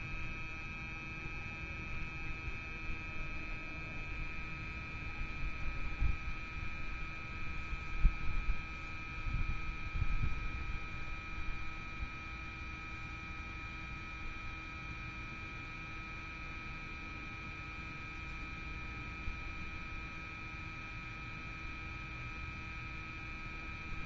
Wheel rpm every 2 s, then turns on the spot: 0, 0, 0, 0, 0, 0, 0, 0, 0, 0, 0, 0.
none